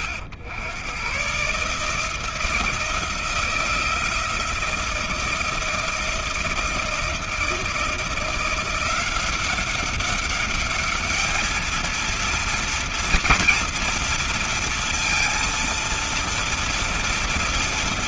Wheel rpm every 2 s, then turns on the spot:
90, 160, 170, 170, 170, 210, 230, 230, 230.
none